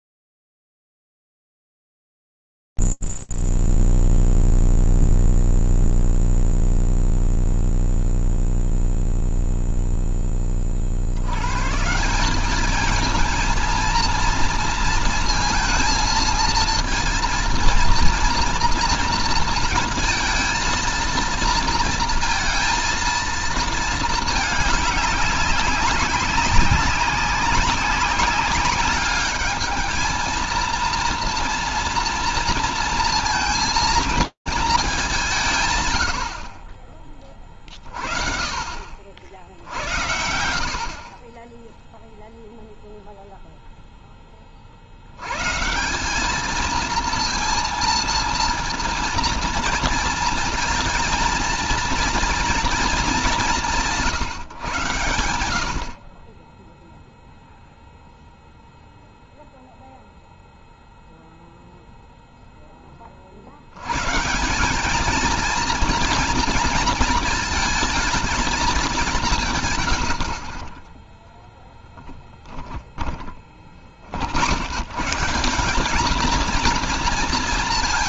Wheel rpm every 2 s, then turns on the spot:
0, 0, 0, 0, 0, 10, 180, 230, 230, 230, 230, 230, 210, 190, 190, 220, 230, 220, 40, 60, 50, 0, 80, 230, 230, 230, 210, 110, 0, 0, 0, 10, 190, 230, 210, 40, 10, 100, 220.
70-74